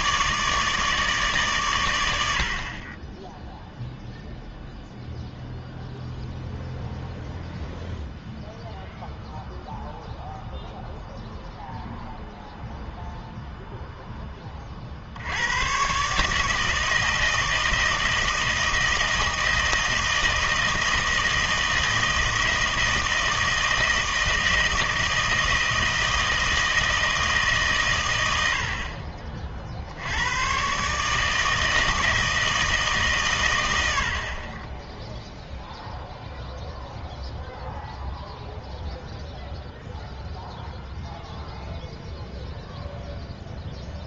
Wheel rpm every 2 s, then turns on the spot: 160, 40, 0, 0, 0, 0, 0, 40, 160, 160, 160, 160, 160, 160, 50, 140, 150, 10, 0, 0, 0, 0.
none